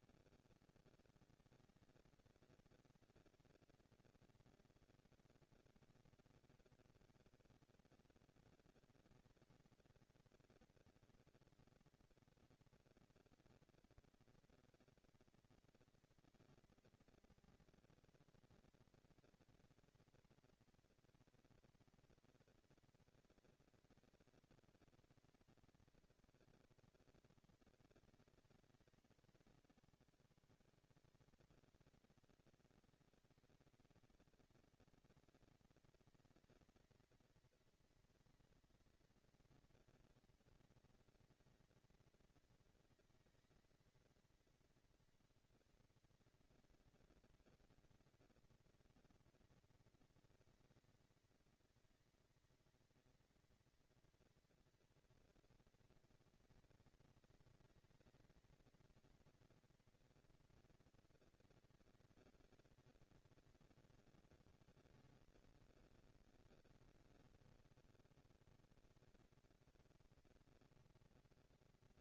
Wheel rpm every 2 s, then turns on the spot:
170, 220, 230, 240, 230, 230, 230, 230, 230, 230, 230, 230, 230, 230, 220, 200, 190, 210, 220, 230, 230, 230, 230, 230, 230, 230, 220, 230, 230, 230, 240, 230, 210, 200, 210, 230.
none